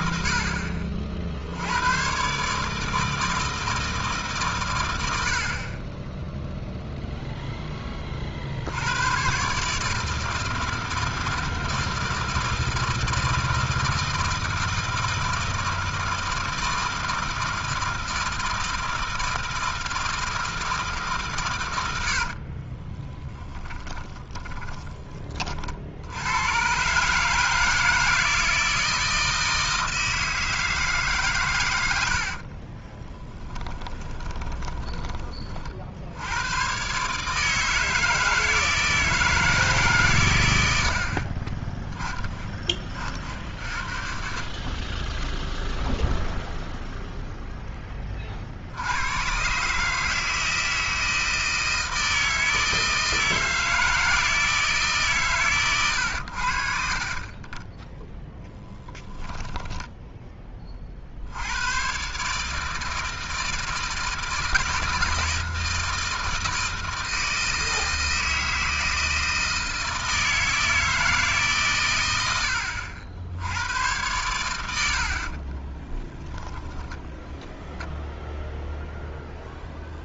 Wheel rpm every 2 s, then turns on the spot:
70, 160, 40, 10, 140, 160, 160, 160, 160, 160, 120, 20, 60, 160, 160, 100, 10, 40, 160, 150, 30, 50, 10, 0, 130, 160, 160, 140, 30, 10, 60, 160, 160, 160, 160, 160, 90, 80, 10, 0.
22-24 32-34 58-60 76-78